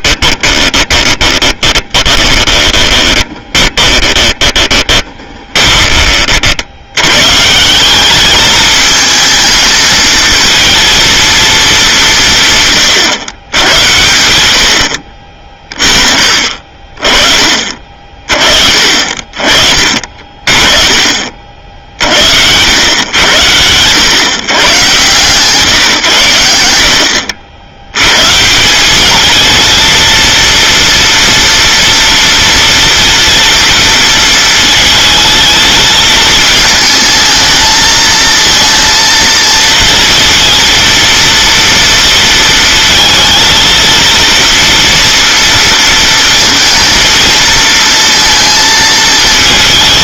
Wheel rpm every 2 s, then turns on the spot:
20, 20, 20, 70, 210, 230, 130, 80, 50, 40, 30, 100, 130, 80, 180, 230, 230, 220, 220, 230, 230, 230, 240, 230, 230.
0-6